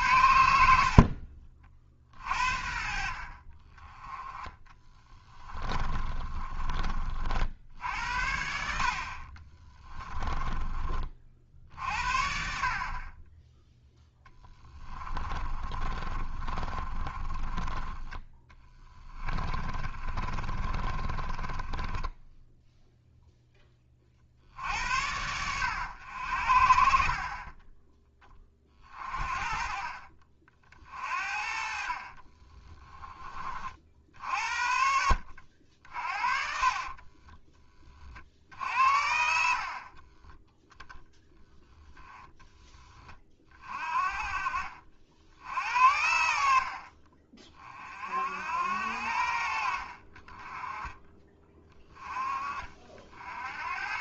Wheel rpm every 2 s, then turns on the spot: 60, 50, 20, 40, 60, 30, 40, 30, 30, 20, 30, 0, 80, 50, 30, 40, 20, 60, 30, 70, 20, 10, 50, 50, 70, 20, 40.
0-2 4-6 14-22 32-38